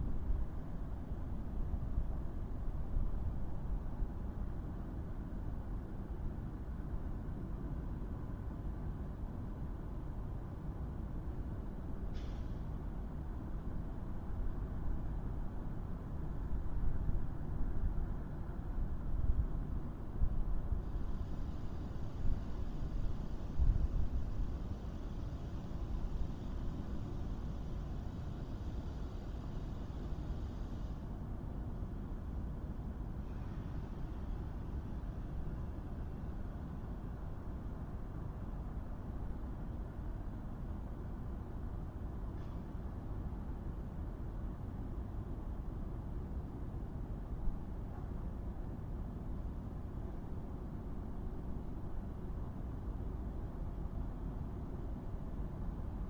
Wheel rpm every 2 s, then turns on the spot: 0, 0, 0, 0, 0, 0, 0, 0, 0, 0, 0, 0, 0, 0, 0, 0, 0, 0, 0, 0, 0, 0, 0, 0, 0, 0, 0, 0.
none